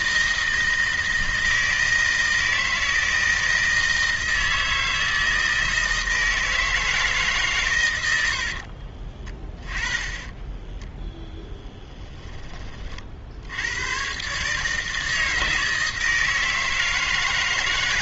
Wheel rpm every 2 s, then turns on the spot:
160, 160, 160, 150, 40, 10, 40, 160, 160.
8-12